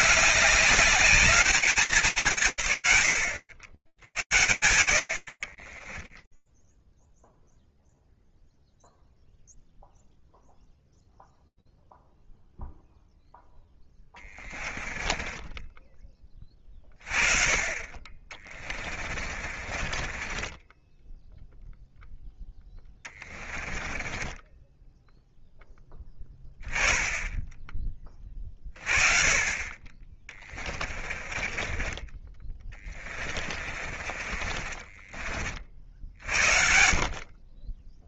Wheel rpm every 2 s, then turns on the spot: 210, 150, 100, 10, 0, 0, 0, 20, 30, 30, 10, 20, 10, 10, 30, 30, 20, 30, 60.
6-8 14-16 18-26 30-32 34-36